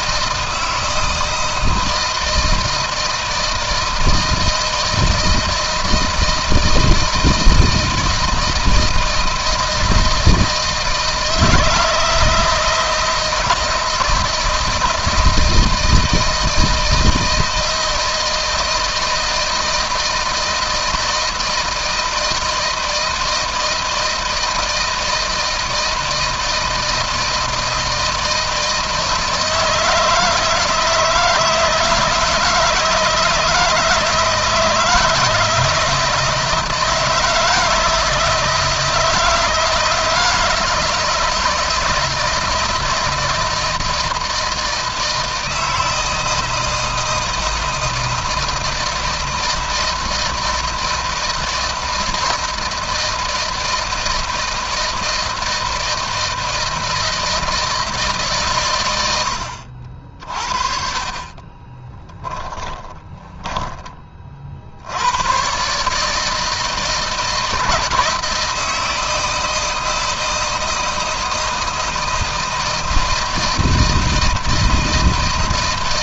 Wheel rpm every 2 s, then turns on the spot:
160, 160, 160, 160, 160, 170, 160, 160, 160, 160, 160, 170, 160, 160, 160, 160, 160, 160, 170, 170, 160, 160, 160, 160, 160, 160, 160, 110, 40, 10, 40, 160, 160, 160, 160, 160, 160, 160.
56-60